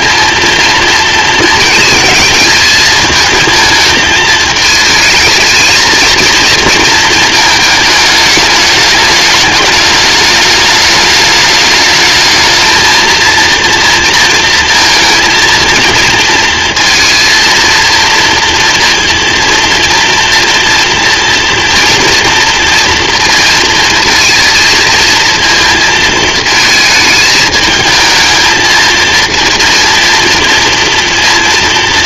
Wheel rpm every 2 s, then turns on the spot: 230, 220, 220, 230, 210, 220, 220, 230, 230, 230, 240, 230, 230, 220, 220, 230.
none